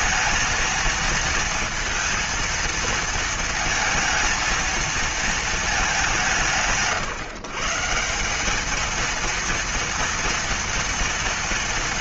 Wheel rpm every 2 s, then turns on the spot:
220, 230, 230, 160, 200, 230.
none